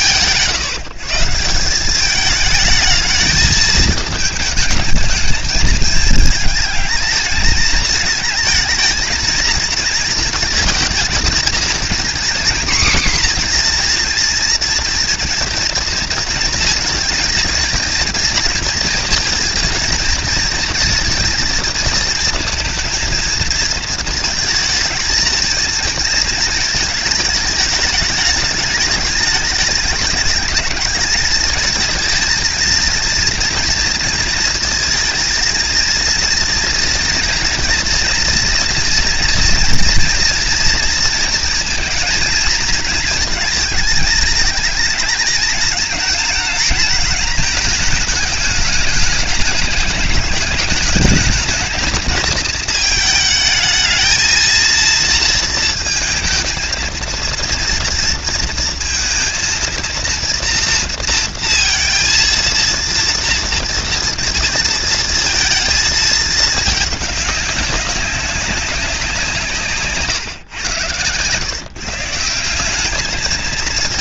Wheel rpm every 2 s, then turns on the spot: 160, 210, 220, 210, 230, 230, 250, 230, 230, 220, 230, 230, 220, 220, 210, 220, 230, 230, 230, 230, 230, 230, 220, 220, 210, 220, 220, 230, 230, 230, 230, 230, 230, 210, 170, 110, 210.
none